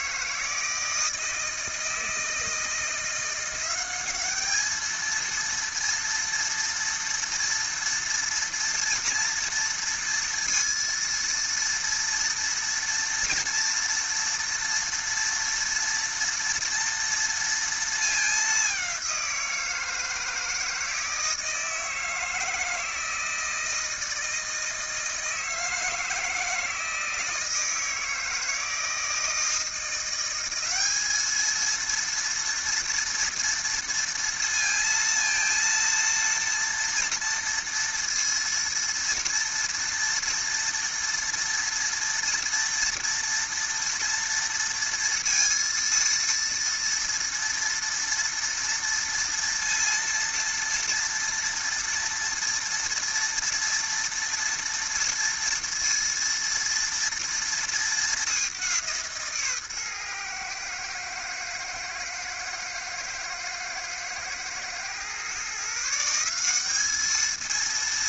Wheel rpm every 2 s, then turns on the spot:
160, 160, 210, 230, 230, 230, 230, 230, 230, 200, 160, 160, 160, 160, 160, 190, 230, 230, 230, 230, 240, 230, 230, 230, 230, 230, 230, 230, 230, 190, 120, 110, 120, 190.
none